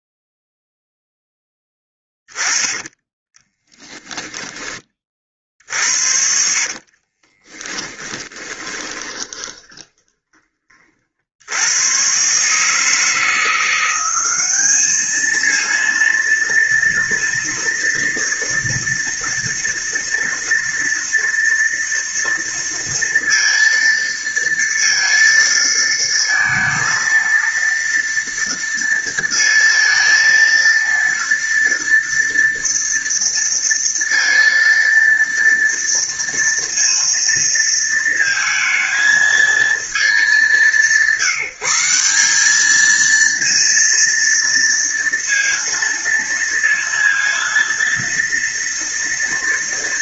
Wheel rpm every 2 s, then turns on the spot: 0, 20, 20, 50, 20, 40, 150, 210, 230, 230, 230, 230, 230, 230, 230, 230, 230, 230, 230, 220, 180, 210, 230, 230, 230.
2-4 6-10